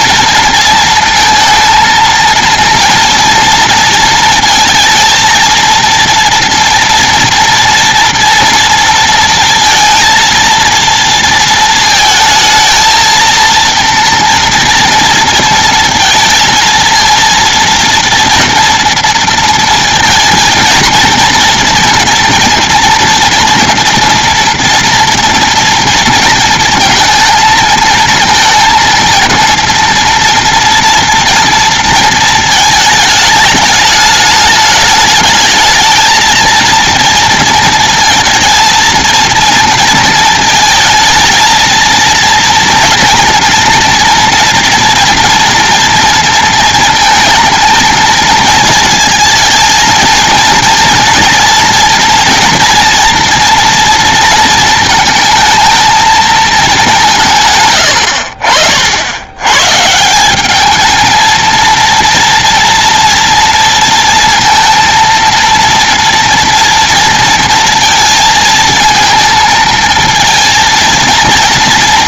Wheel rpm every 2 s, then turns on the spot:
230, 230, 230, 230, 230, 230, 230, 230, 230, 230, 230, 230, 230, 230, 230, 230, 220, 210, 230, 220, 220, 230, 230, 230, 230, 230, 230, 220, 190, 80, 220, 230, 230, 230, 220, 230.
none